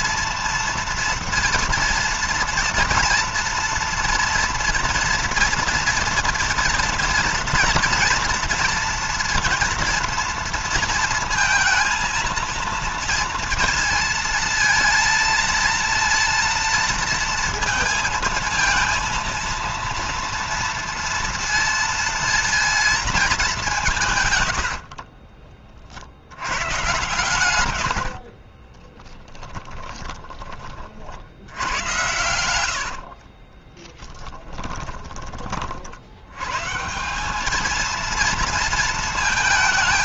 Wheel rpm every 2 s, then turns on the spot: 230, 240, 230, 230, 230, 230, 230, 230, 230, 230, 230, 230, 70, 120, 30, 50, 70, 20, 150, 230.
24-26 28-30 32-34